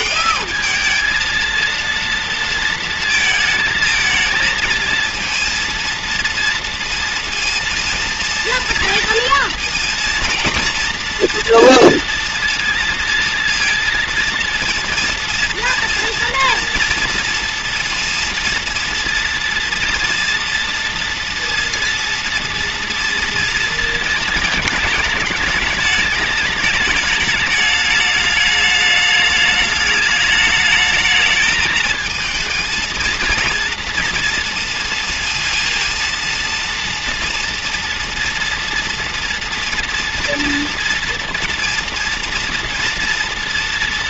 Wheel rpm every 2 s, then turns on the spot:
220, 230, 220, 230, 230, 230, 230, 230, 230, 230, 230, 230, 220, 210, 210, 210, 230, 230, 230, 230, 230, 230.
none